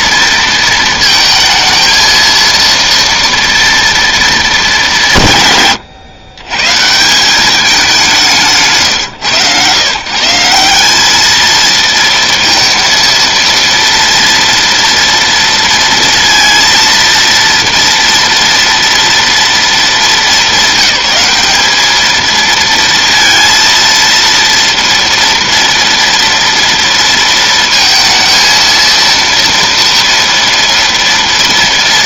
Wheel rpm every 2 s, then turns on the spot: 220, 230, 190, 150, 160, 210, 230, 230, 230, 230, 190, 230, 230, 230, 230, 230.
none